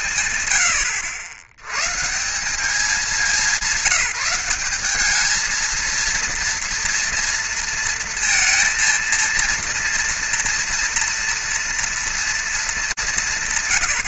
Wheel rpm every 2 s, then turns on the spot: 100, 100, 190, 220, 230, 230, 240.
none